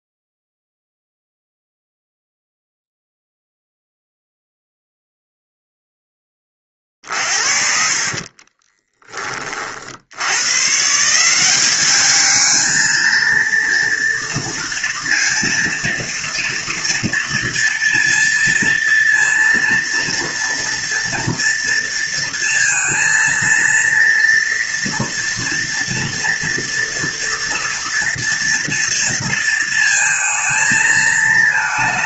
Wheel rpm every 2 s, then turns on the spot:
0, 0, 0, 30, 20, 130, 220, 230, 230, 230, 230, 230, 230, 230, 230, 220.
8-10